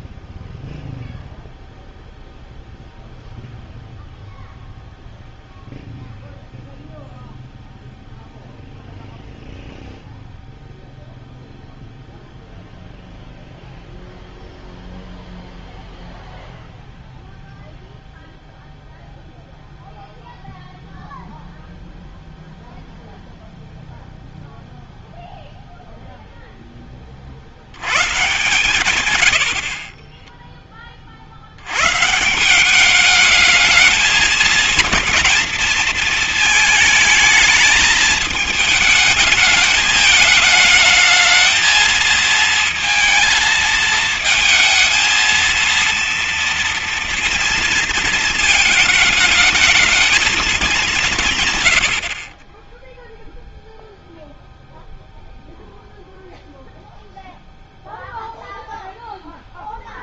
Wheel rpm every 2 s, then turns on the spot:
0, 0, 0, 0, 0, 0, 0, 0, 0, 0, 0, 0, 0, 10, 130, 10, 180, 220, 220, 220, 220, 230, 220, 230, 220, 210, 30, 0, 0, 0.
none